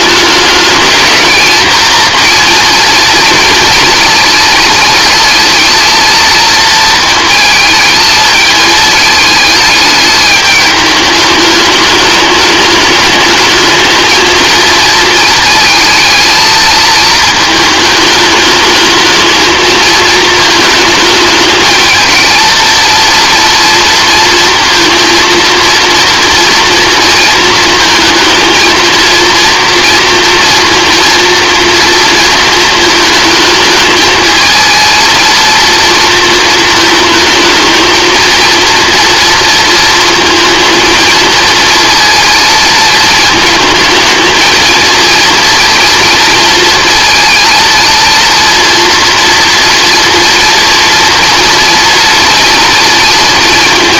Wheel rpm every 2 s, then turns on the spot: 210, 240, 220, 230, 220, 210, 210, 220, 230, 210, 220, 230, 230, 230, 230, 230, 220, 220, 220, 230, 230, 220, 230, 230, 230, 230, 230.
none